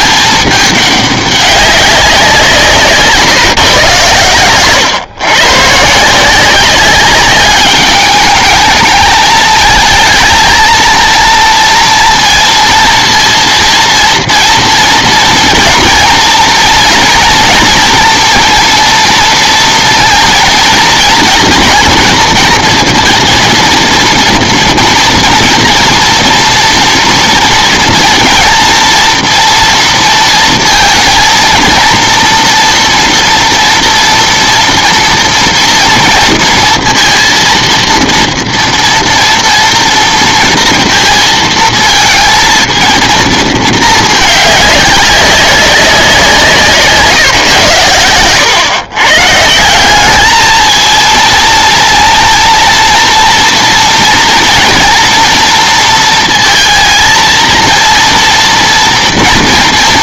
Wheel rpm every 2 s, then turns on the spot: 210, 170, 120, 180, 210, 230, 230, 230, 230, 230, 230, 230, 230, 230, 230, 230, 230, 230, 230, 240, 230, 230, 210, 160, 110, 220, 230, 230, 230, 230.
none